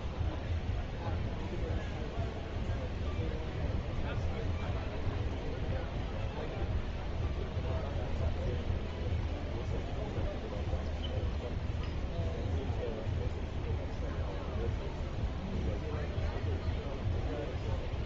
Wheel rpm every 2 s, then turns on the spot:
0, 0, 0, 0, 0, 0, 0, 0, 0.
none